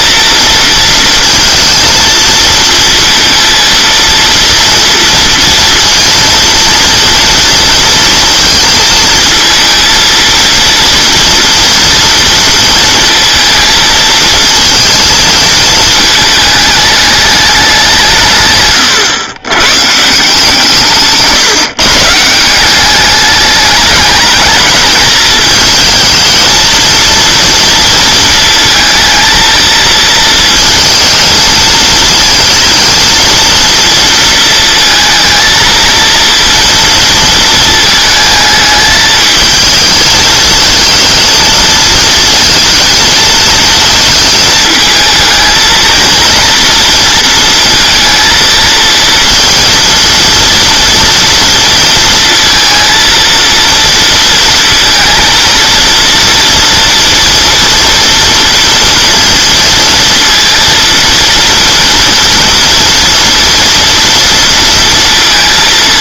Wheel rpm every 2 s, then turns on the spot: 230, 230, 230, 230, 230, 230, 230, 230, 210, 140, 160, 180, 210, 230, 230, 230, 220, 230, 230, 220, 230, 230, 220, 230, 230, 230, 230, 230, 230, 230, 230, 230, 230.
18-20